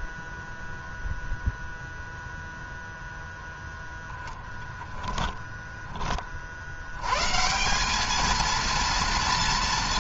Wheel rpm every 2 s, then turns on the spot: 0, 0, 10, 100, 230.
4-6